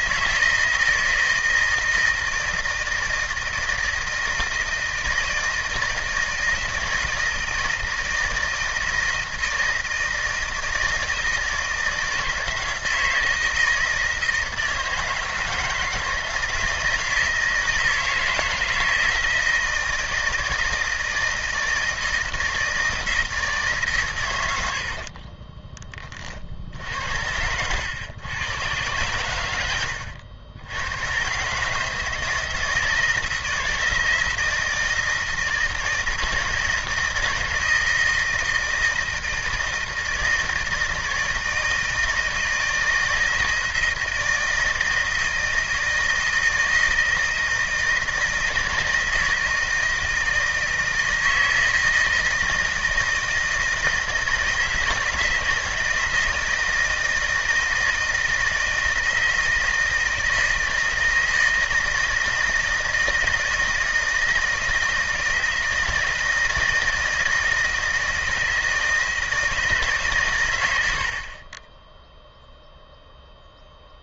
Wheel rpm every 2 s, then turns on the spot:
160, 160, 160, 160, 160, 160, 160, 160, 160, 160, 160, 160, 80, 60, 110, 100, 160, 160, 160, 160, 160, 160, 160, 160, 160, 160, 160, 160, 160, 160, 160, 160, 160, 160, 160, 90, 0.
none